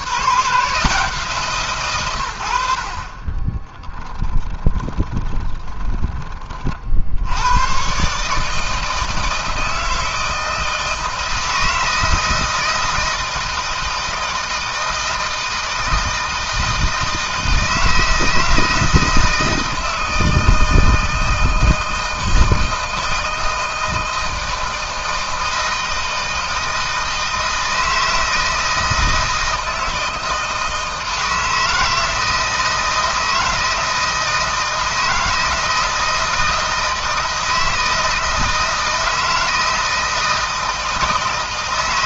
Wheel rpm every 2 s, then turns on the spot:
150, 70, 10, 50, 160, 160, 160, 160, 160, 160, 160, 160, 160, 160, 160, 160, 160, 160, 160, 160, 160.
4-6